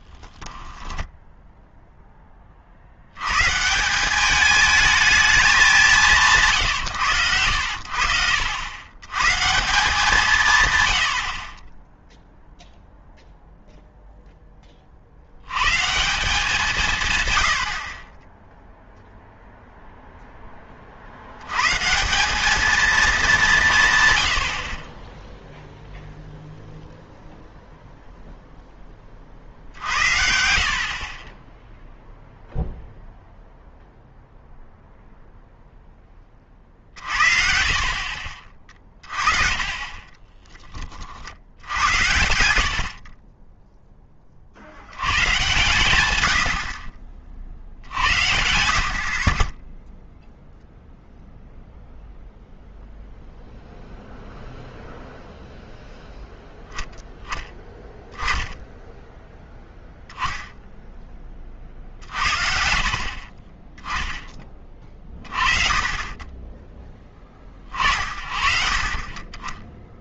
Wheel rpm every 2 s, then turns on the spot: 10, 40, 210, 140, 80, 130, 0, 20, 180, 0, 20, 220, 40, 0, 10, 60, 0, 0, 40, 30, 10, 80, 70, 50, 70, 0, 0, 0, 0, 10, 0, 50, 20, 20, 50.
0-2 38-40 42-44